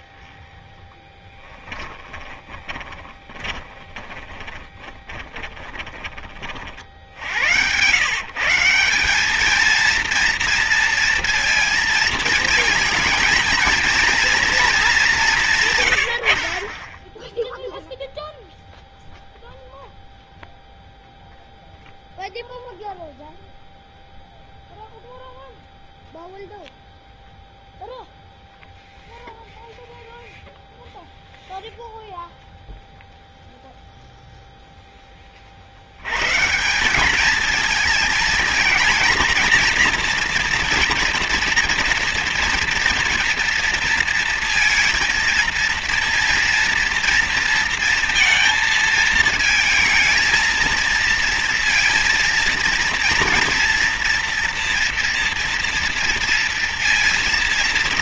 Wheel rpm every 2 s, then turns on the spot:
20, 30, 20, 40, 160, 230, 220, 230, 80, 0, 0, 0, 0, 0, 0, 0, 0, 0, 140, 220, 230, 230, 230, 230, 220, 220, 230, 230, 230.
0-8